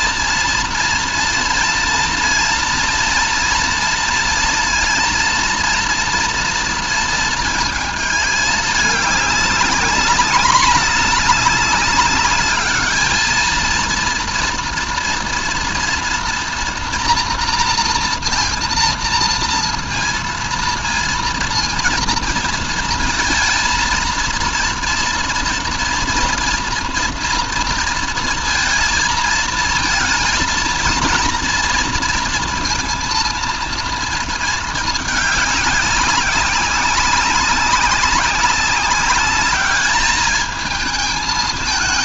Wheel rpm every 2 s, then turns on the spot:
230, 240, 230, 230, 210, 210, 210, 230, 230, 230, 230, 230, 230, 230, 230, 230, 230, 230, 200, 200, 220.
none